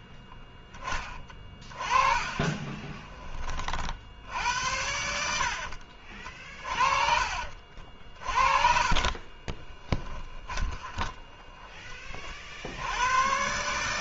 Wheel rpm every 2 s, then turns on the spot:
10, 20, 70, 40, 40, 20, 50.
2-4 6-12